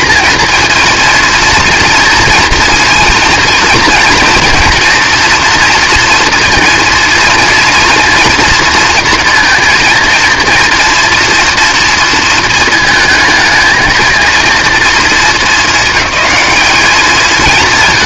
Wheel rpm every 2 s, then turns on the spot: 230, 230, 230, 230, 230, 240, 220, 230, 200.
none